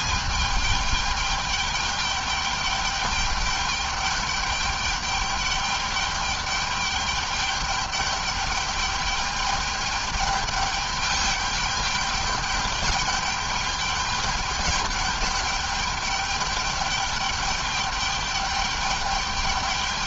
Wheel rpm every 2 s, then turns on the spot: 210, 210, 210, 210, 210, 210, 210, 210, 210, 210.
none